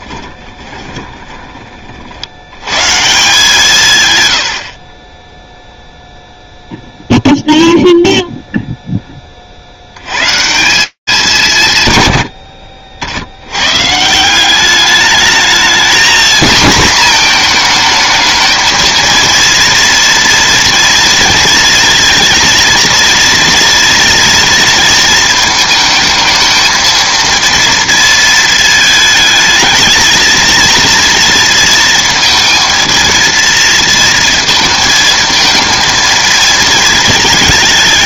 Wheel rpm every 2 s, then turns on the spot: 10, 150, 30, 0, 10, 160, 60, 210, 230, 230, 230, 230, 230, 230, 220, 230, 230, 220, 220.
0-2 4-6